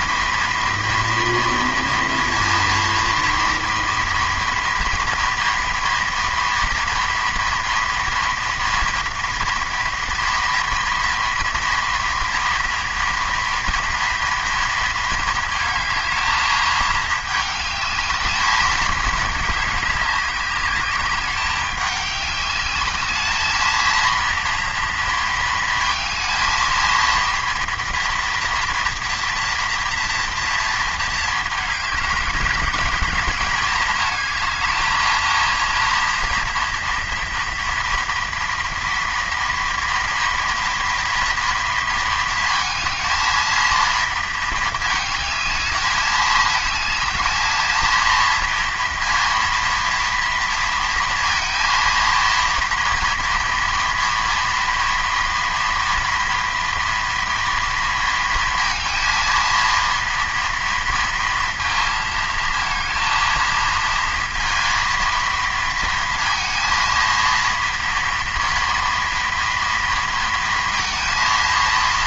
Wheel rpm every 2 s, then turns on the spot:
230, 230, 230, 230, 240, 230, 240, 230, 220, 210, 200, 200, 230, 230, 240, 230, 200, 220, 230, 230, 230, 230, 230, 220, 230, 230, 230, 230, 230, 230, 230, 220, 230, 230, 230, 230.
none